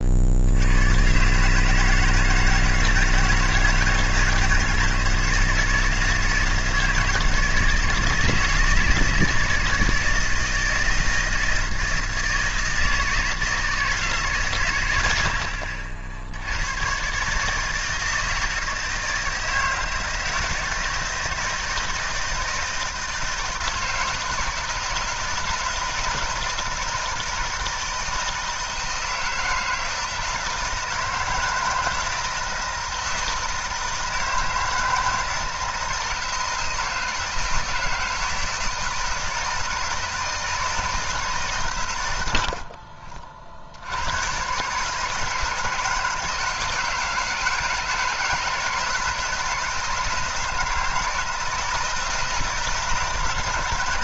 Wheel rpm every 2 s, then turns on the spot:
130, 160, 160, 160, 160, 170, 160, 110, 120, 160, 160, 160, 160, 160, 160, 160, 160, 160, 160, 160, 160, 40, 160, 170, 160, 160, 160.
none